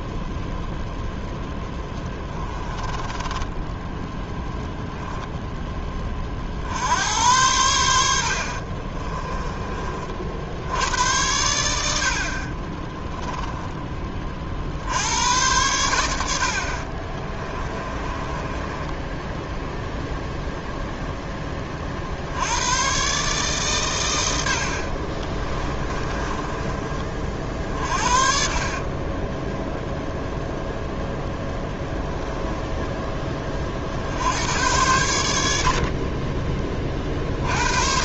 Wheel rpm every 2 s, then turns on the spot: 0, 10, 0, 70, 30, 90, 30, 60, 50, 10, 10, 110, 60, 30, 30, 0, 10, 100, 30.
2-4 8-10 12-14 16-20 24-26 32-34